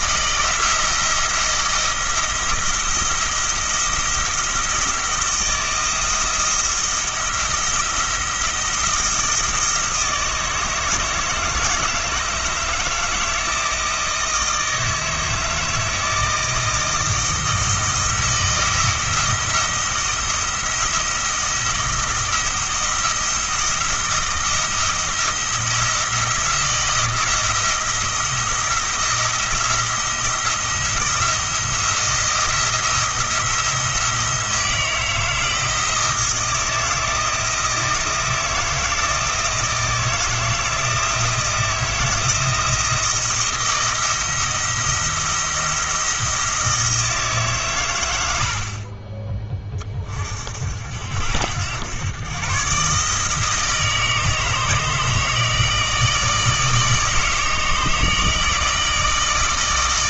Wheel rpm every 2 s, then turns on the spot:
170, 170, 160, 170, 170, 160, 160, 160, 160, 170, 170, 170, 170, 170, 170, 170, 170, 160, 160, 160, 160, 160, 170, 170, 70, 50, 140, 160, 160, 160.
none